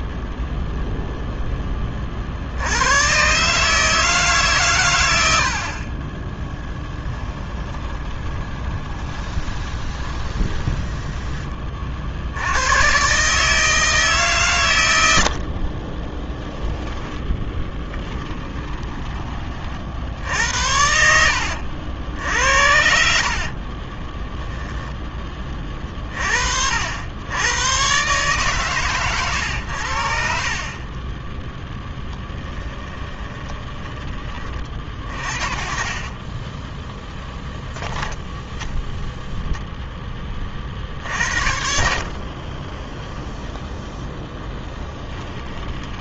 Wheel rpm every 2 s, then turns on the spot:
0, 100, 90, 10, 20, 10, 120, 110, 10, 20, 80, 70, 20, 80, 120, 20, 20, 50, 10, 0, 70, 10, 10.
6-10 16-18 30-34 42-46